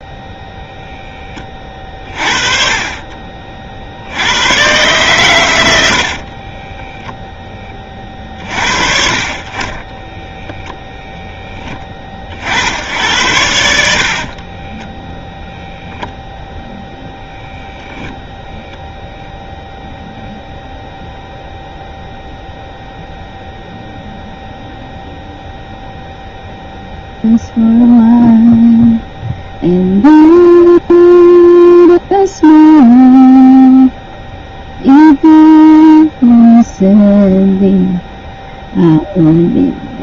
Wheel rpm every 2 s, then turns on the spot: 0, 30, 120, 10, 50, 0, 70, 10, 0, 0, 0, 0, 0, 0, 0, 0, 0, 0, 0, 0.
6-8 14-16